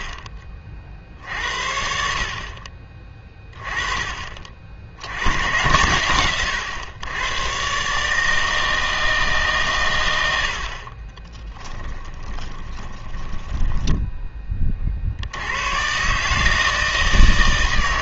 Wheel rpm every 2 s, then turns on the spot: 50, 40, 60, 110, 160, 70, 30, 30, 160.
12-14